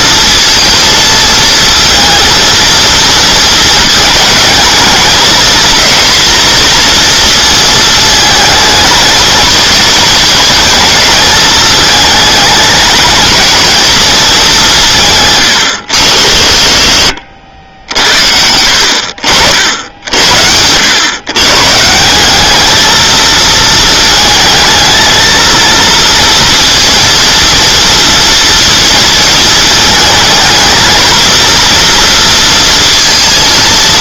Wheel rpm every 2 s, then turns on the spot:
230, 230, 220, 240, 220, 230, 210, 180, 50, 80, 80, 210, 220, 230, 230, 220, 230.
none